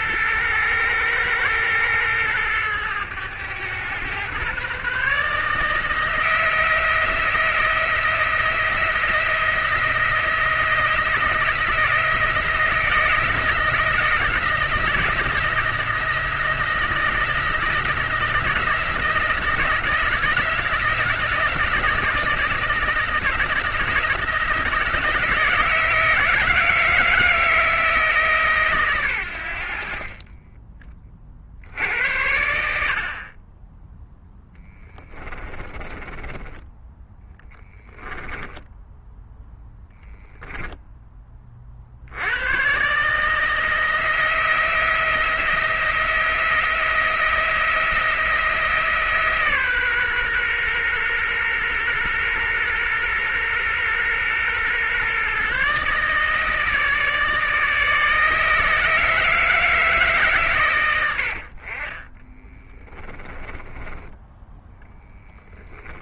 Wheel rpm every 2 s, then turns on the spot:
110, 110, 140, 170, 170, 170, 170, 160, 170, 170, 170, 160, 160, 160, 130, 20, 70, 10, 10, 10, 10, 130, 170, 170, 160, 120, 120, 130, 160, 160, 110, 20, 10.
34-36 62-64